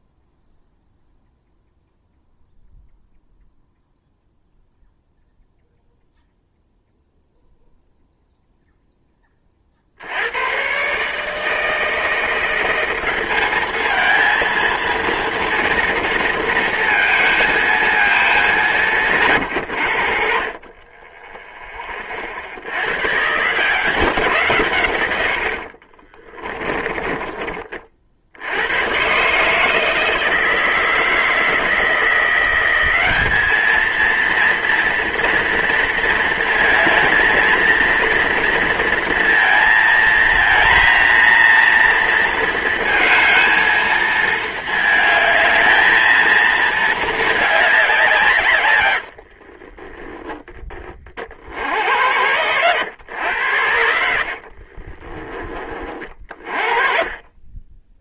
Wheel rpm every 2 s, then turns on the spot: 0, 0, 0, 0, 0, 120, 180, 230, 230, 180, 30, 90, 120, 20, 100, 160, 190, 230, 220, 230, 230, 230, 220, 220, 120, 30, 110, 40, 30.
26-28 48-50 54-56